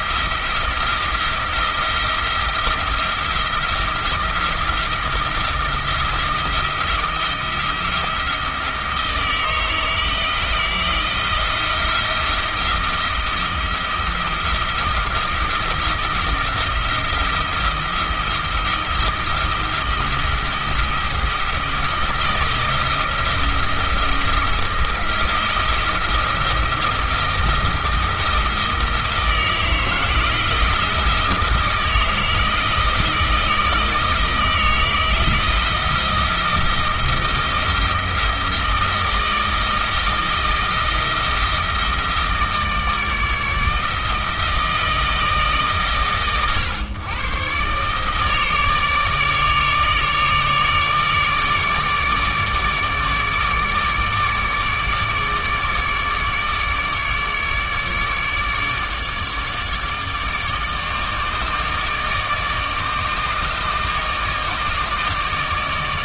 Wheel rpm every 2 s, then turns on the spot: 170, 170, 170, 170, 160, 170, 170, 170, 170, 170, 170, 170, 170, 170, 160, 170, 160, 160, 160, 160, 160, 160, 160, 120, 150, 150, 150, 150, 150, 150, 150, 150, 150.
none